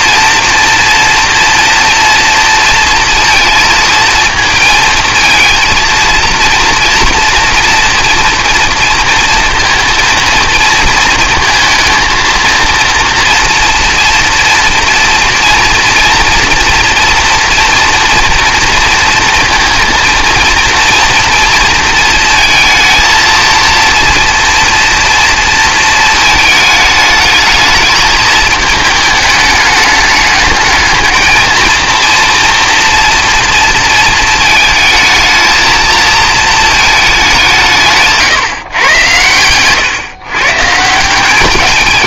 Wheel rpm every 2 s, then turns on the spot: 240, 230, 230, 230, 230, 230, 230, 240, 230, 230, 230, 220, 240, 220, 220, 210, 230, 220, 220, 120, 150.
none